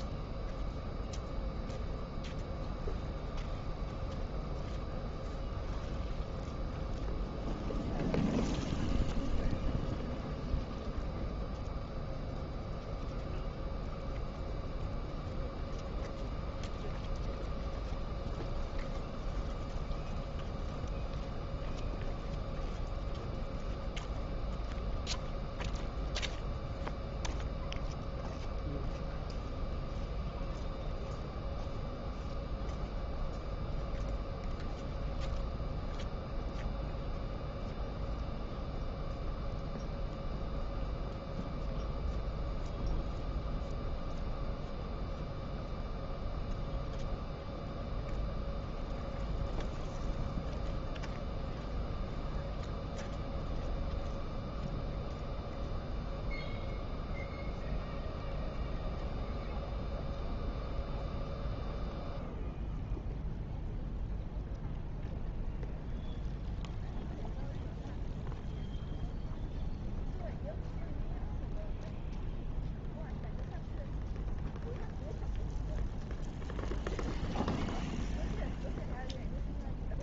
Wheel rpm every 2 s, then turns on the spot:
0, 0, 0, 0, 0, 0, 0, 0, 0, 0, 0, 0, 0, 0, 0, 0, 0, 0, 0, 0, 0, 0, 0, 0, 0, 0, 0, 0, 0, 0, 0, 0, 0, 0, 0, 0, 0, 0, 0, 0.
none